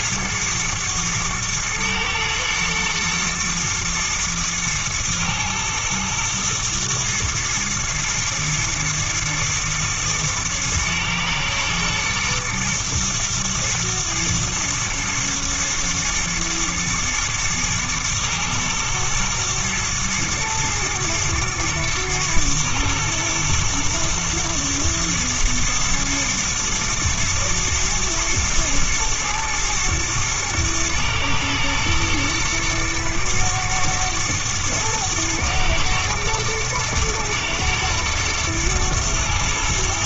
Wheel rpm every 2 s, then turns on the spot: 110, 110, 110, 110, 110, 110, 110, 110, 120, 110, 110, 110, 110, 110, 110, 110, 120, 110, 110, 120.
none